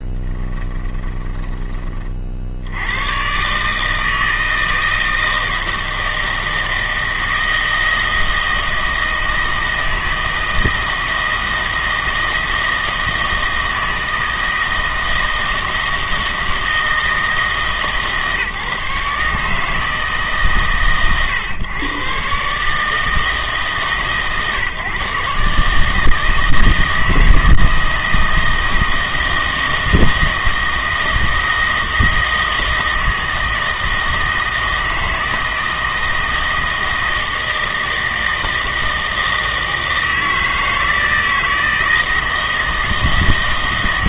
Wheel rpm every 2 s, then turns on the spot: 20, 80, 160, 160, 160, 160, 160, 160, 160, 150, 130, 150, 140, 160, 160, 160, 160, 160, 160, 160, 160, 160.
0-2